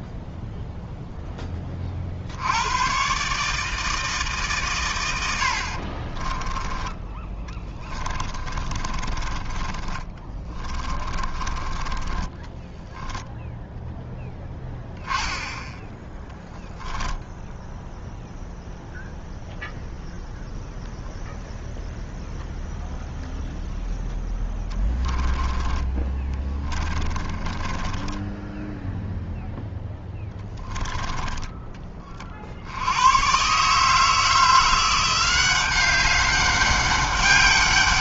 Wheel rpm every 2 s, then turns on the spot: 0, 100, 140, 20, 20, 20, 10, 10, 10, 0, 0, 0, 10, 20, 10, 10, 80, 170, 200.
6-12 24-28